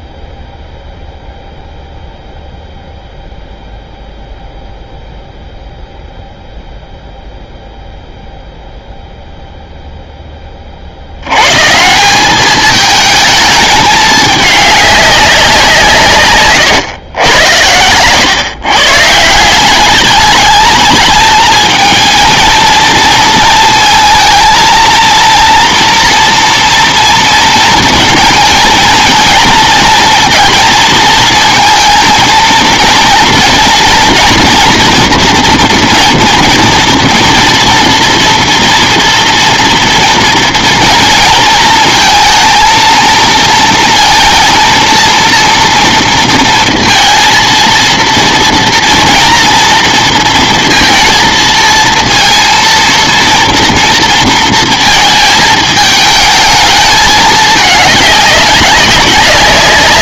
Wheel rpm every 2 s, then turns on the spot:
0, 0, 0, 0, 0, 30, 210, 210, 110, 130, 210, 230, 220, 230, 230, 230, 220, 230, 230, 230, 230, 230, 230, 230, 230, 230, 230, 230, 220, 200.
none